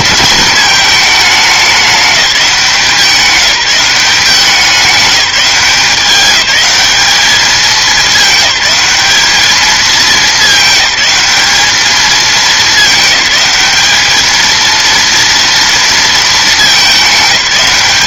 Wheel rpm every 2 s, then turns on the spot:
220, 180, 190, 210, 210, 200, 210, 230, 200.
none